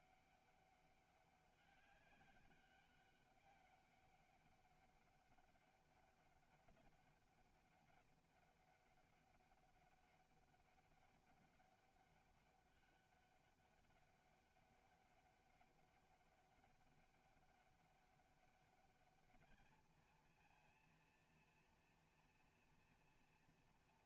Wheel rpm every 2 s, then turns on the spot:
200, 200, 200, 200, 200, 200, 200, 200, 200, 200, 230, 240.
none